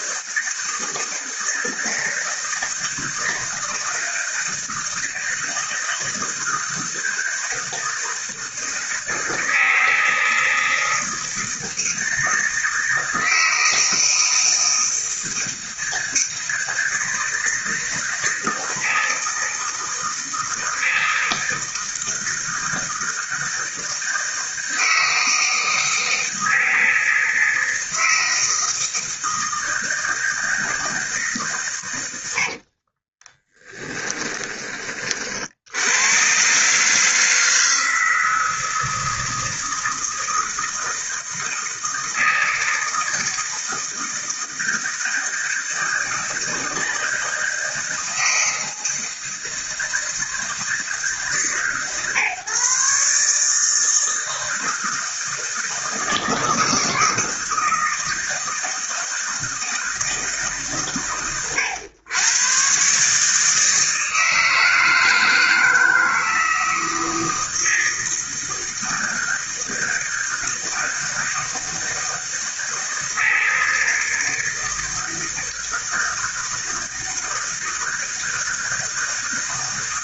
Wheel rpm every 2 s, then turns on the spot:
160, 160, 160, 160, 160, 160, 160, 160, 160, 160, 160, 160, 160, 160, 160, 160, 60, 20, 140, 160, 160, 160, 160, 160, 160, 160, 140, 160, 160, 160, 130, 130, 160, 160, 160, 160, 160, 160, 160, 160.
32-34